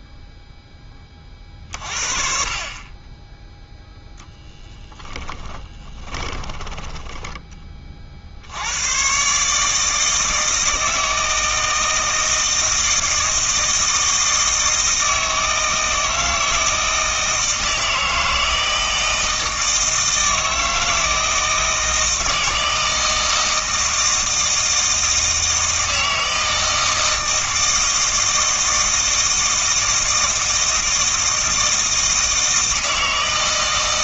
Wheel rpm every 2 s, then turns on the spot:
10, 30, 10, 10, 90, 160, 160, 160, 160, 160, 160, 160, 160, 160, 160, 160, 160.
6-8